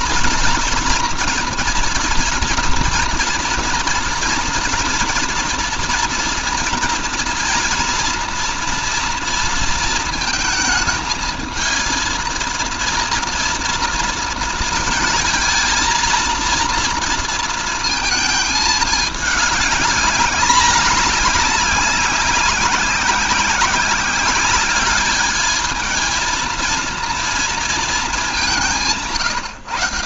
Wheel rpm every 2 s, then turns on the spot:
240, 230, 230, 230, 230, 220, 230, 230, 230, 220, 200, 190, 200, 230, 170.
none